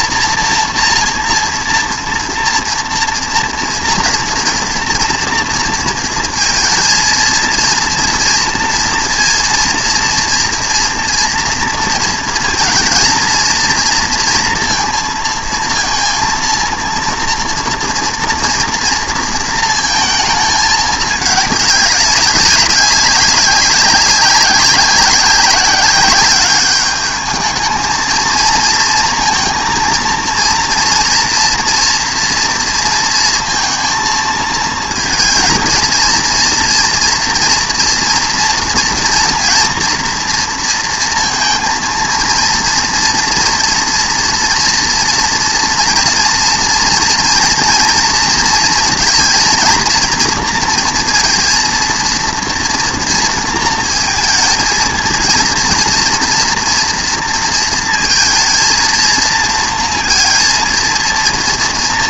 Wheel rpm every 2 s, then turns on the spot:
230, 240, 230, 230, 230, 240, 230, 230, 230, 230, 220, 200, 190, 210, 230, 230, 230, 230, 230, 230, 230, 230, 230, 230, 230, 230, 230, 230, 230, 230, 230.
none